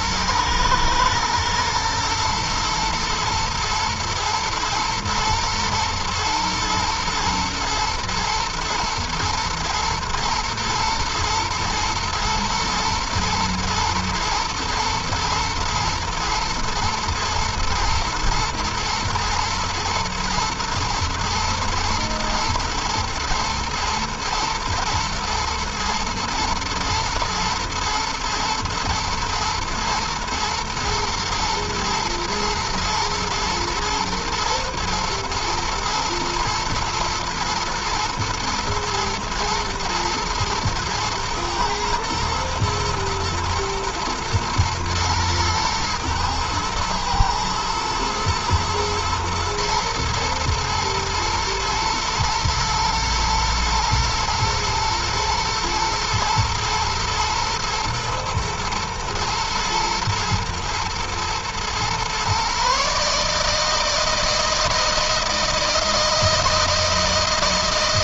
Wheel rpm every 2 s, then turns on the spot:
120, 120, 110, 110, 110, 110, 120, 110, 110, 120, 120, 120, 120, 120, 110, 120, 110, 120, 110, 110, 120, 110, 120, 110, 110, 110, 120, 110, 120, 110, 110, 150, 160, 160.
none